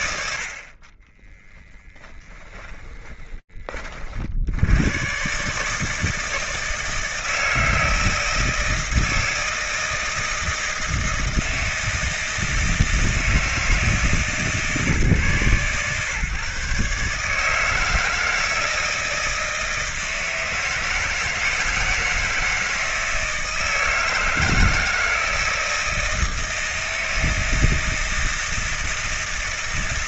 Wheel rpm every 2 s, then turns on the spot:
40, 20, 110, 160, 160, 160, 160, 130, 150, 160, 160, 160, 170, 160, 160.
2-4